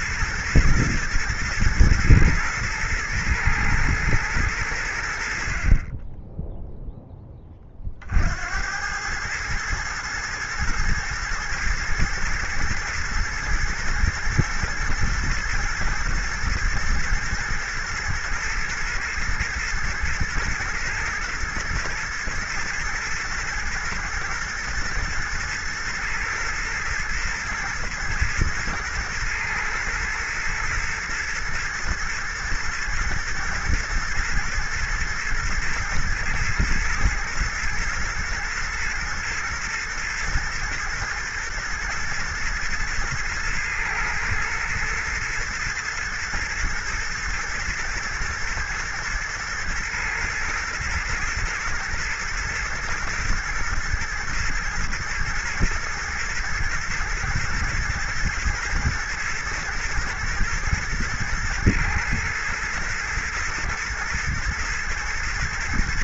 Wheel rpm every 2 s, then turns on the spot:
120, 110, 90, 10, 90, 110, 110, 120, 110, 110, 110, 110, 110, 120, 110, 110, 110, 110, 110, 120, 120, 120, 110, 110, 110, 120, 110, 120, 120, 120, 120, 110, 120.
none